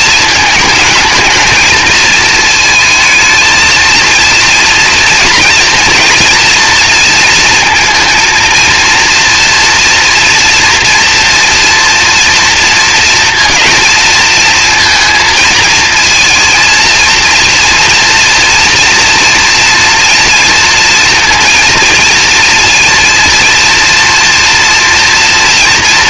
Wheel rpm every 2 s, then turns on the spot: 220, 220, 230, 230, 230, 240, 230, 230, 230, 230, 230, 230, 230.
none